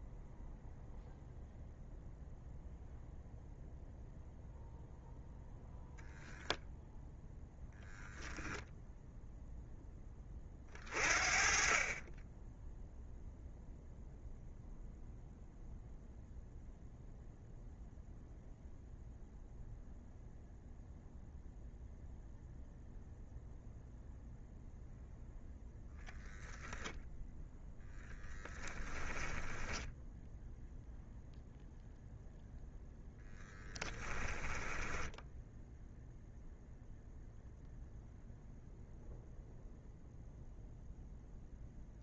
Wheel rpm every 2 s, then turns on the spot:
0, 0, 0, 0, 0, 30, 0, 0, 0, 0, 0, 0, 0, 0, 10, 0, 0, 10, 0, 0, 0.
none